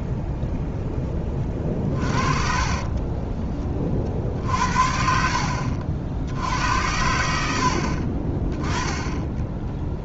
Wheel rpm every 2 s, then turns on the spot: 0, 30, 50, 90, 10.
2-4